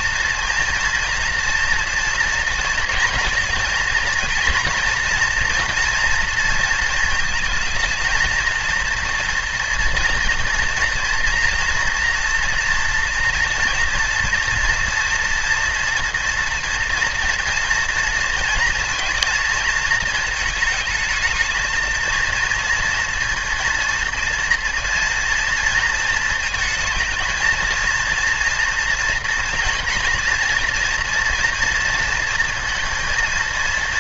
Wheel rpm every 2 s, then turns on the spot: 230, 230, 230, 230, 230, 230, 230, 230, 230, 230, 220, 230, 230, 230, 230, 240, 230.
none